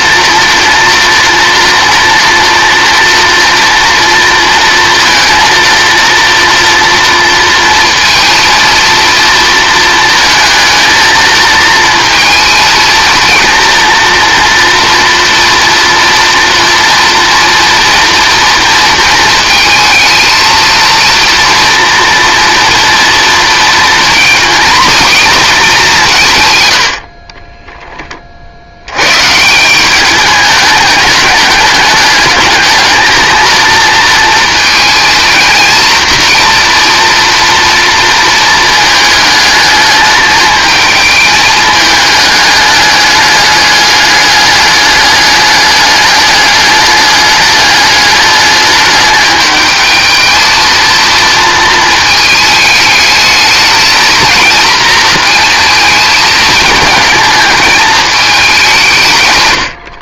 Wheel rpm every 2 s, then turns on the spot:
230, 230, 230, 230, 230, 220, 230, 230, 230, 230, 230, 240, 240, 100, 80, 200, 220, 220, 230, 220, 220, 210, 210, 210, 210, 220, 220, 230, 220, 190.
26-28